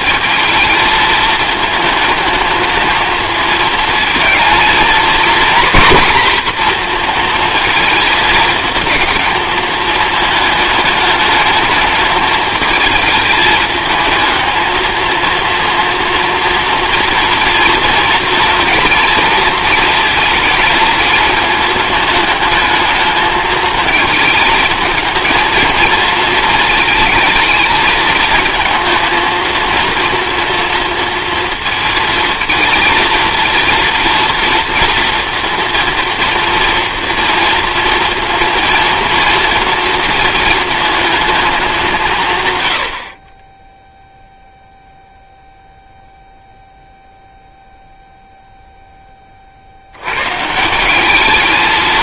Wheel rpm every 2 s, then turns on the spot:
220, 220, 230, 240, 220, 210, 220, 220, 230, 230, 230, 220, 220, 220, 230, 230, 220, 230, 230, 230, 220, 100, 0, 0, 0, 160.
none